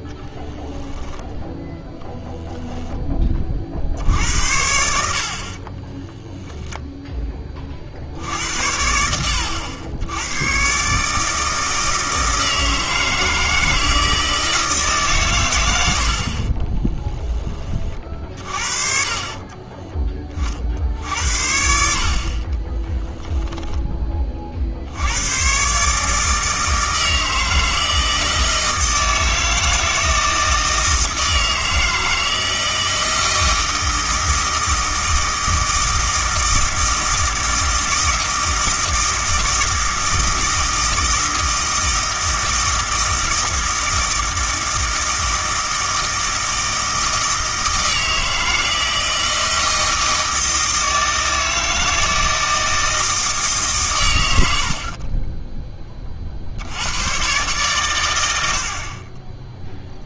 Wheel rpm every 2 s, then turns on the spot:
0, 10, 80, 0, 80, 130, 160, 150, 20, 50, 60, 20, 60, 160, 160, 160, 160, 160, 160, 160, 160, 160, 160, 160, 160, 160, 160, 60, 90, 60.
16-20 22-24